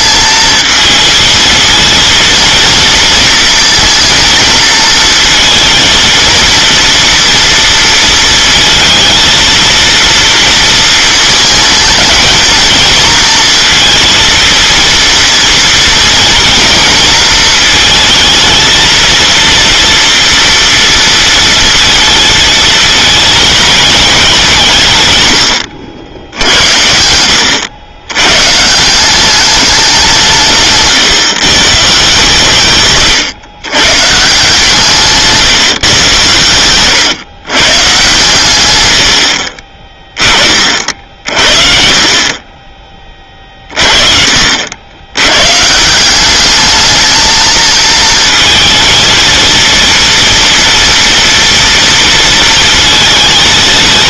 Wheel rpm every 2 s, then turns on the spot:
230, 230, 220, 230, 230, 220, 230, 240, 230, 230, 230, 220, 130, 70, 170, 140, 130, 160, 110, 100, 50, 30, 80, 210, 230, 230, 230.
none